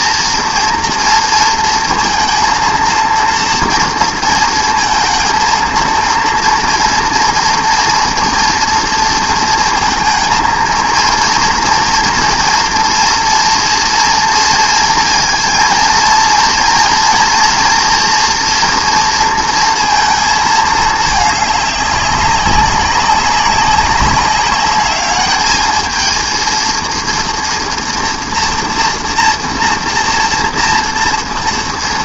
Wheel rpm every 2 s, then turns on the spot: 230, 230, 230, 230, 230, 230, 230, 230, 230, 230, 210, 190, 210, 230, 230, 230.
none